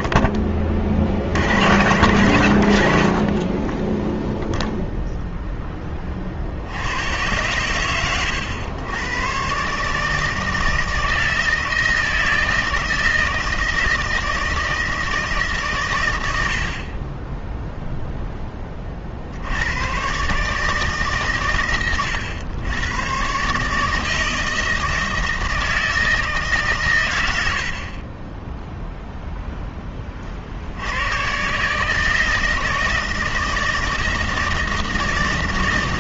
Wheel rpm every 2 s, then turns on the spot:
20, 90, 0, 80, 100, 160, 160, 160, 60, 20, 150, 110, 160, 140, 0, 60, 160, 160.
none